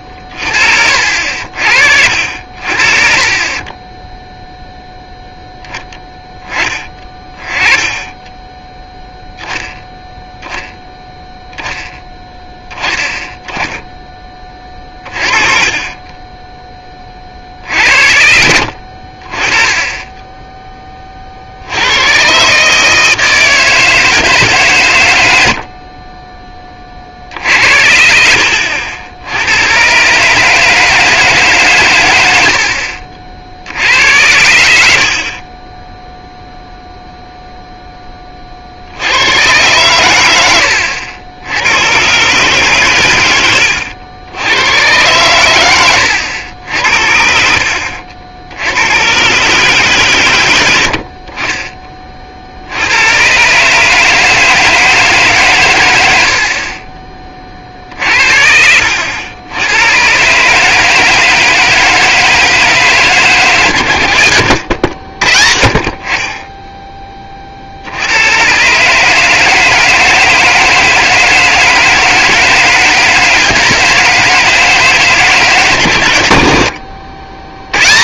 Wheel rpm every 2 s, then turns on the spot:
50, 50, 10, 30, 10, 0, 10, 20, 10, 60, 10, 140, 130, 40, 80, 160, 70, 70, 0, 60, 80, 120, 110, 80, 80, 80, 70, 160, 50, 70, 150, 160, 90, 10, 120, 160, 160, 160, 80.
50-52 56-60 64-66 76-78